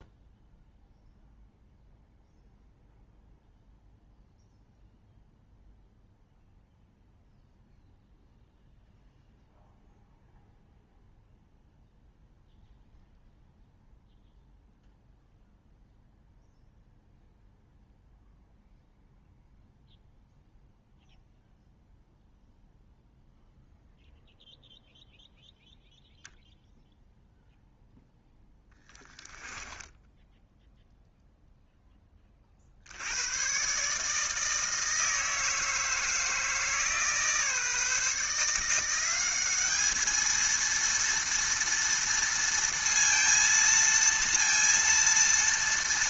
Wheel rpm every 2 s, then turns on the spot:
0, 0, 0, 0, 0, 0, 0, 0, 0, 0, 0, 0, 0, 0, 10, 10, 60, 160, 160, 160, 230, 230, 230.
28-32